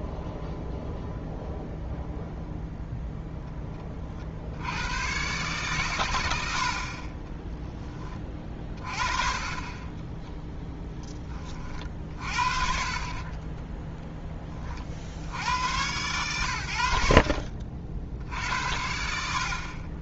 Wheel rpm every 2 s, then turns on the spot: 0, 0, 110, 40, 40, 20, 40, 60, 90, 80.
none